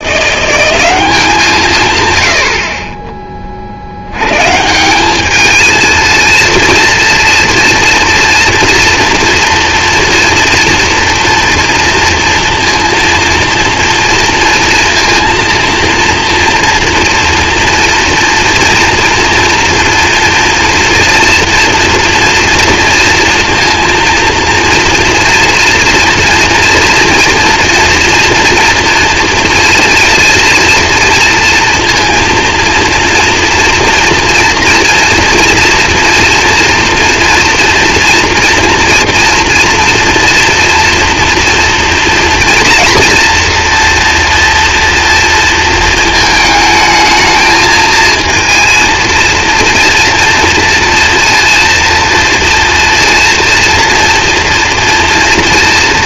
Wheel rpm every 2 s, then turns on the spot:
190, 40, 150, 230, 230, 230, 230, 230, 230, 230, 230, 230, 230, 230, 230, 230, 230, 240, 230, 230, 240, 230, 230, 220, 230, 230, 230, 230.
none